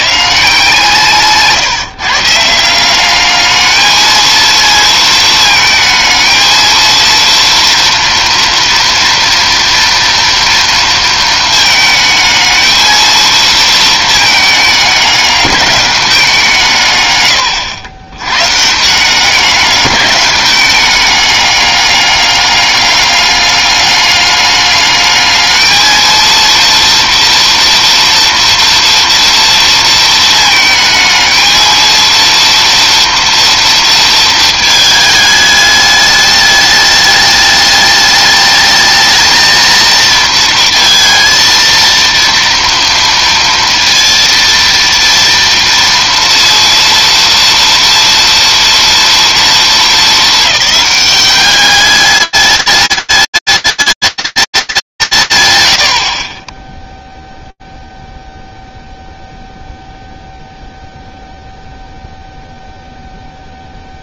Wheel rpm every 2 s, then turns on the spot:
150, 160, 230, 220, 230, 230, 220, 210, 170, 140, 200, 200, 210, 230, 230, 220, 230, 220, 210, 210, 230, 230, 230, 230, 230, 210, 210, 210, 40, 0, 0, 0.
none